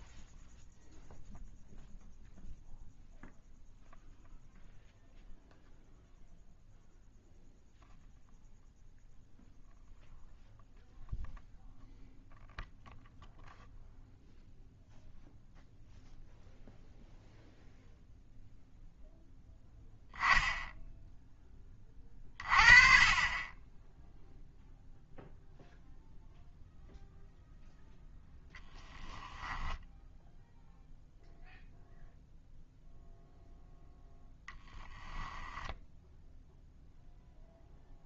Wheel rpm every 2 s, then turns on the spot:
0, 0, 0, 0, 0, 0, 0, 0, 0, 0, 10, 30, 0, 0, 10, 0, 0, 10, 0.
28-30 34-36